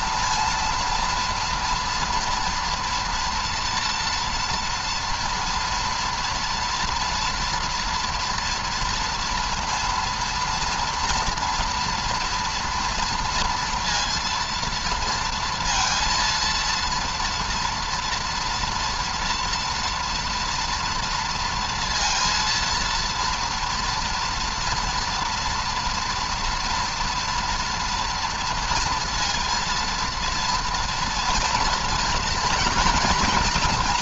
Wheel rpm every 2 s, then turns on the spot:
230, 230, 230, 240, 230, 230, 230, 230, 230, 230, 230, 230, 240, 230, 230, 230, 230.
none